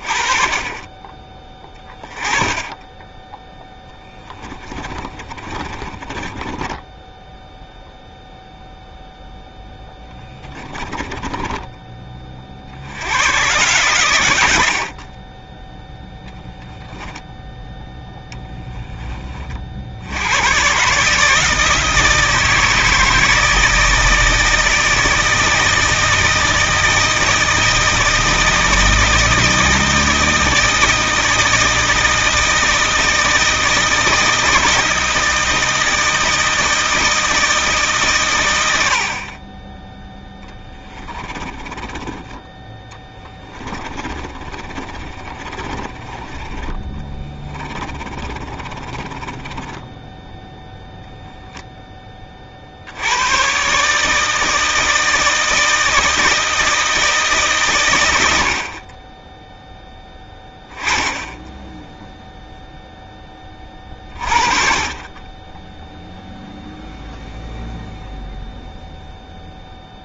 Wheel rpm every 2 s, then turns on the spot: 20, 10, 30, 10, 0, 20, 80, 50, 0, 10, 140, 160, 160, 160, 160, 160, 160, 160, 160, 70, 20, 10, 30, 20, 20, 0, 70, 160, 160, 30, 10, 0, 30, 0, 0.
4-8 10-12 40-46 48-50